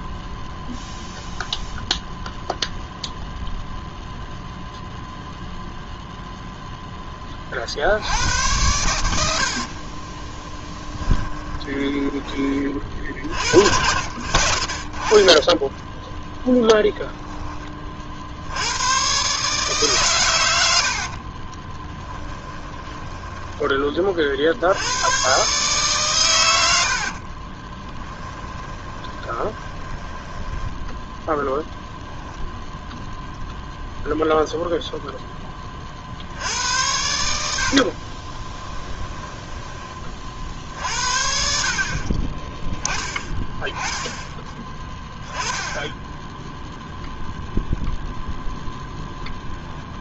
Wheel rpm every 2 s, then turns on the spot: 0, 0, 0, 10, 90, 20, 40, 30, 10, 110, 60, 10, 90, 60, 20, 10, 0, 0, 80, 20, 60, 20, 10, 0, 10.
10-12 20-24 26-30 38-40